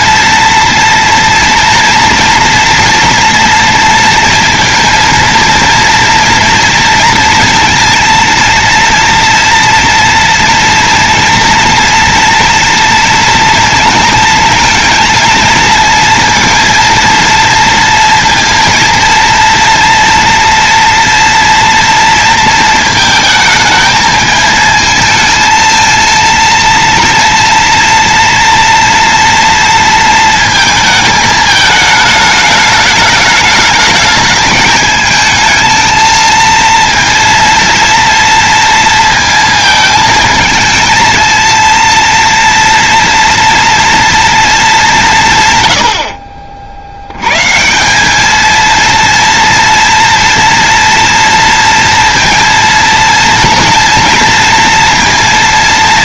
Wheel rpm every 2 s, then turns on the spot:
230, 230, 230, 230, 230, 230, 230, 230, 230, 230, 230, 220, 220, 230, 230, 220, 210, 220, 230, 230, 230, 230, 200, 70, 230, 230, 230, 230.
none